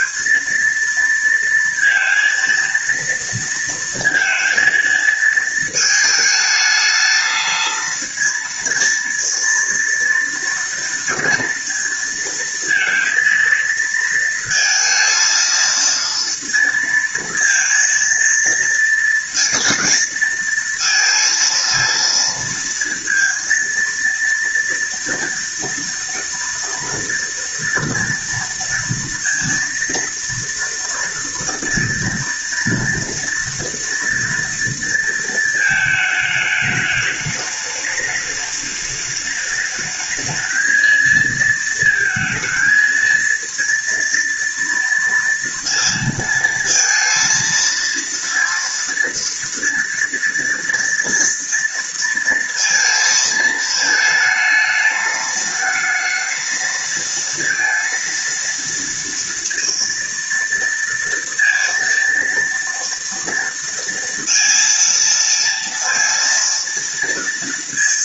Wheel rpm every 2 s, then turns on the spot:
230, 230, 230, 220, 230, 230, 230, 230, 230, 230, 230, 230, 240, 230, 230, 230, 230, 230, 210, 210, 220, 230, 230, 230, 230, 230, 230, 220, 230, 230, 230, 230, 230, 230.
none